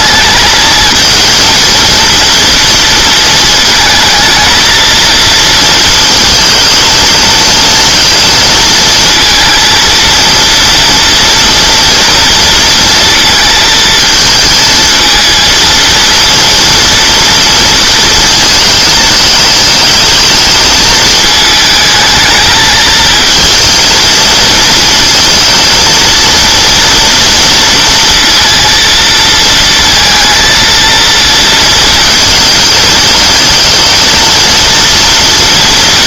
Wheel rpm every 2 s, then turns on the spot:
220, 230, 230, 230, 230, 230, 230, 220, 230, 220, 220, 220, 230, 230, 230, 230, 220, 230.
none